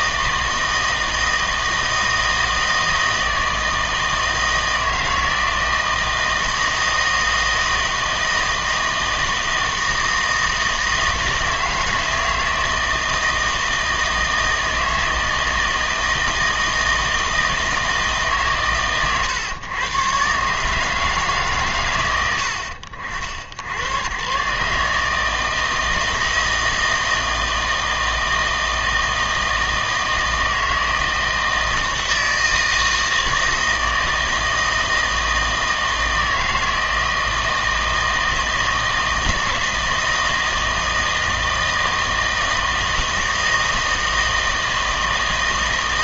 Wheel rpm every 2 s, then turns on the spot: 160, 160, 160, 160, 160, 160, 160, 160, 160, 130, 150, 80, 140, 160, 160, 160, 160, 160, 160, 160, 160, 160, 160.
none